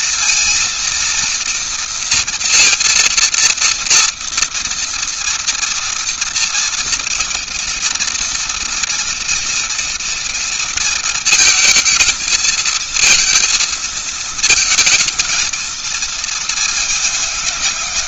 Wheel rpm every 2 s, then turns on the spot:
230, 230, 230, 240, 240, 230, 230, 230, 230.
none